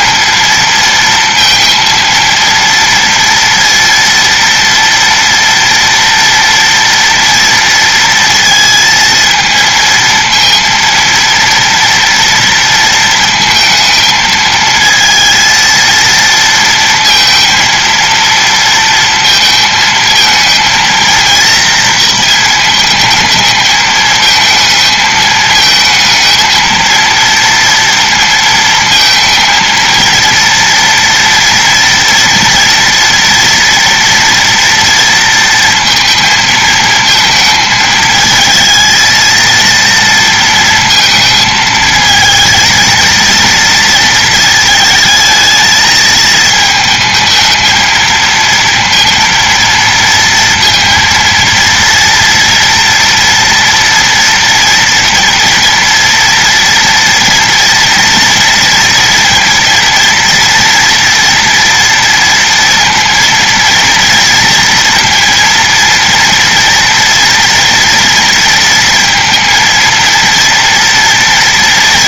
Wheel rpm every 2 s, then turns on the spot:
230, 230, 230, 230, 230, 230, 230, 220, 230, 230, 230, 220, 220, 230, 230, 230, 230, 230, 220, 220, 230, 230, 220, 220, 230, 230, 230, 230, 230, 230, 230, 230, 230, 230, 230, 230.
none